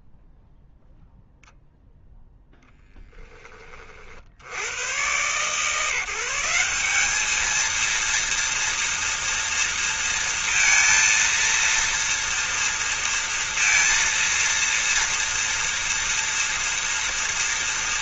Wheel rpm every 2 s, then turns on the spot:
0, 0, 50, 180, 230, 230, 230, 230, 230.
none